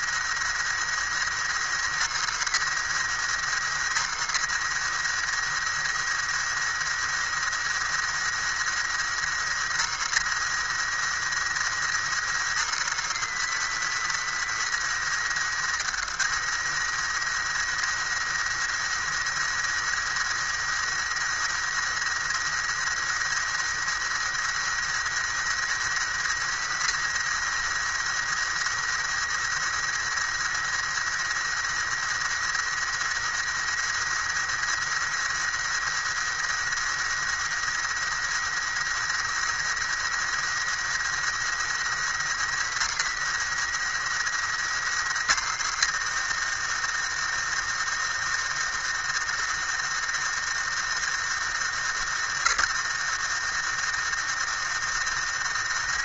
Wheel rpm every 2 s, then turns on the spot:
110, 120, 110, 110, 110, 110, 120, 110, 110, 110, 110, 110, 110, 110, 110, 110, 110, 110, 110, 110, 110, 110, 110, 110, 110, 110, 100, 110.
none